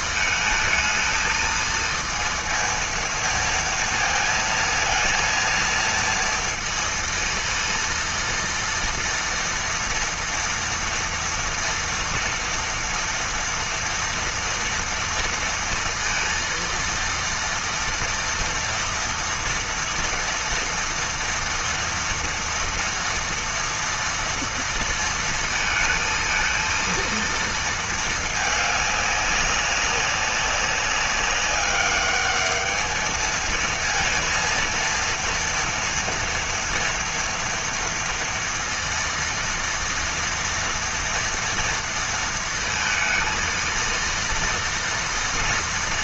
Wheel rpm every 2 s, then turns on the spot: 220, 230, 230, 230, 230, 230, 230, 230, 230, 230, 230, 230, 230, 230, 210, 190, 220, 230, 230, 230, 230, 230, 230.
none